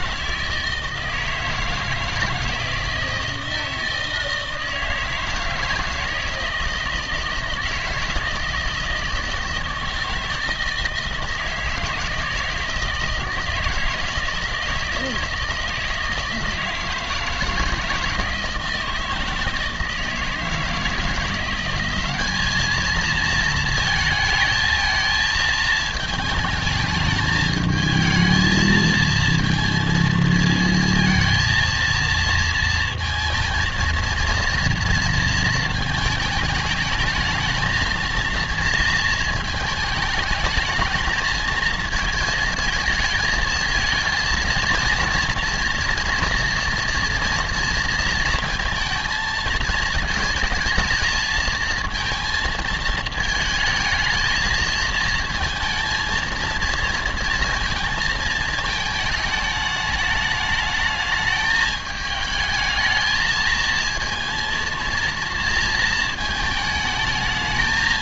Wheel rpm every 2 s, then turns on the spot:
160, 160, 160, 160, 160, 160, 160, 160, 160, 160, 160, 220, 220, 220, 220, 230, 230, 230, 220, 230, 220, 220, 230, 230, 230, 230, 230, 230, 230, 220, 210, 220, 230, 220.
none